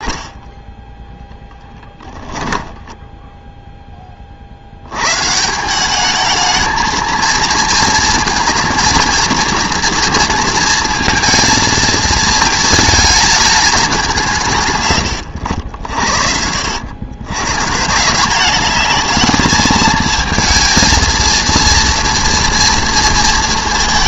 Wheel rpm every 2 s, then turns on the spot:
10, 10, 70, 220, 230, 230, 220, 130, 80, 200, 220, 230.
0-2